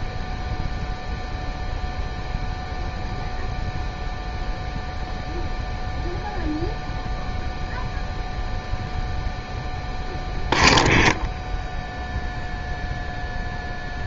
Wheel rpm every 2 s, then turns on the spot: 0, 0, 0, 0, 0, 0, 0.
none